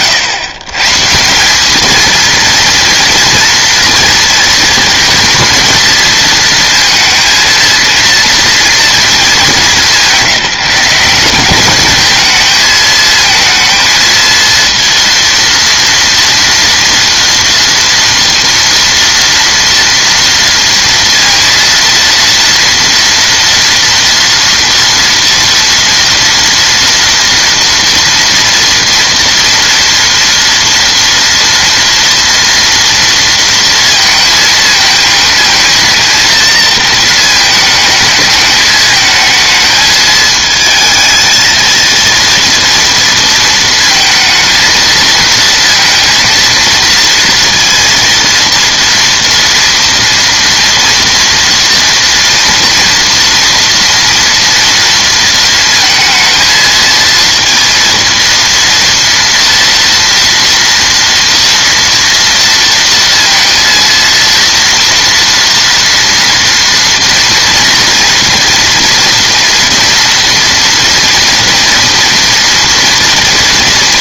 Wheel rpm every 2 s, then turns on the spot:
130, 220, 220, 230, 230, 180, 220, 230, 230, 230, 230, 230, 230, 230, 230, 230, 230, 220, 230, 220, 220, 230, 220, 230, 230, 230, 230, 230, 220, 230, 230, 230, 230, 230, 230, 230, 230.
none